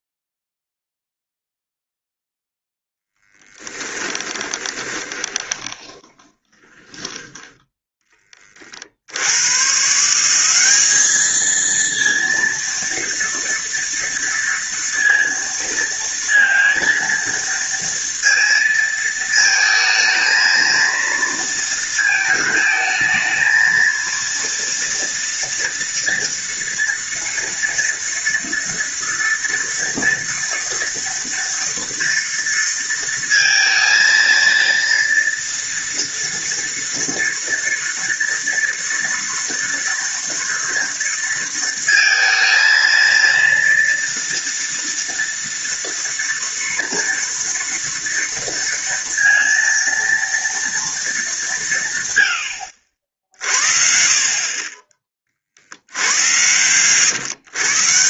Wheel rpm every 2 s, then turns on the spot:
0, 0, 20, 20, 30, 190, 230, 230, 230, 230, 220, 220, 230, 240, 230, 230, 230, 230, 230, 230, 230, 230, 240, 230, 230, 230, 70, 30, 110.
4-8